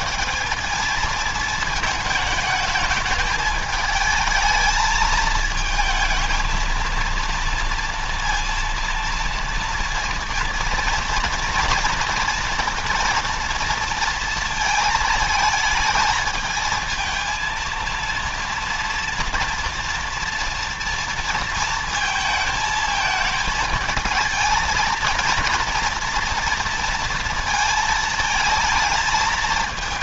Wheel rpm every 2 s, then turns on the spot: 220, 220, 220, 230, 230, 230, 230, 220, 220, 230, 230, 220, 230, 230, 220.
none